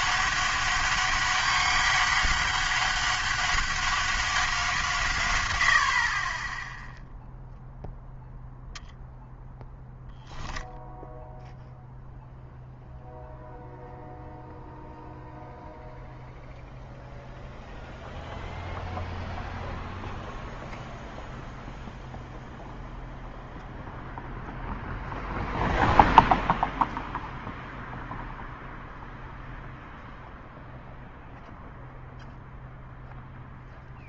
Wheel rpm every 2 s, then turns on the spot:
200, 200, 180, 10, 0, 0, 0, 0, 0, 0, 0, 0, 0, 0, 0, 0, 0.
none